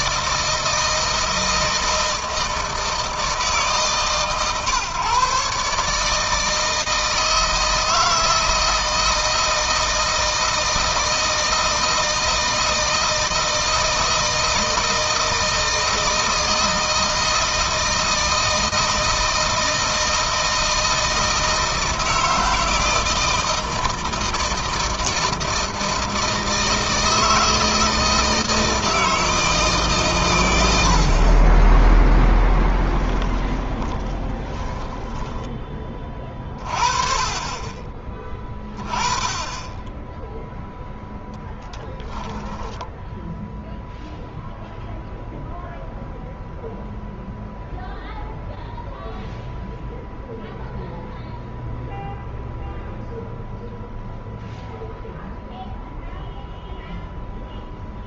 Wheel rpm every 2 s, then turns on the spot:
170, 160, 140, 160, 160, 160, 160, 160, 160, 160, 160, 160, 160, 160, 160, 80, 10, 10, 40, 20, 0, 10, 0, 0, 0, 0, 0, 0, 0.
32-36